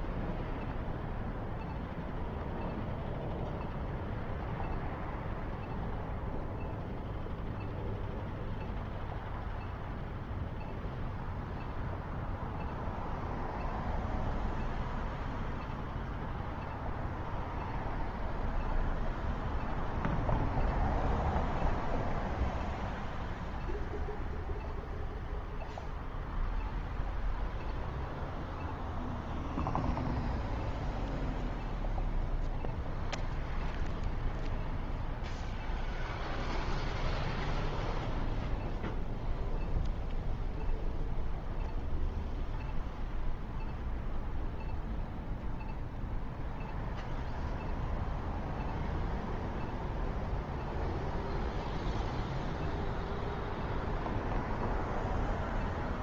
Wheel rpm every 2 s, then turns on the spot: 0, 0, 0, 0, 0, 0, 0, 0, 0, 0, 0, 0, 0, 0, 0, 0, 0, 0, 0, 0, 0, 0, 0, 0, 0, 0, 0, 0.
none